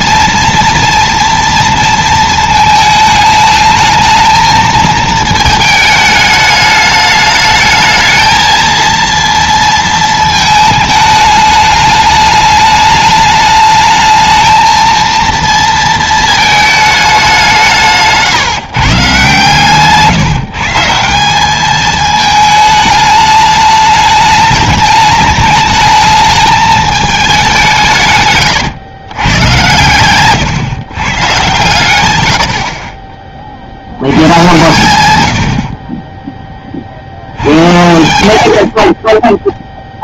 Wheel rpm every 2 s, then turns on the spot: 230, 220, 220, 210, 230, 220, 210, 220, 220, 150, 160, 220, 210, 210, 120, 140, 40, 120, 50, 30.
38-40